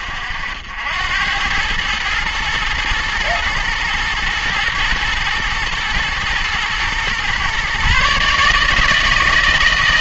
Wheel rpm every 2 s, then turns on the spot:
70, 110, 110, 110, 150.
none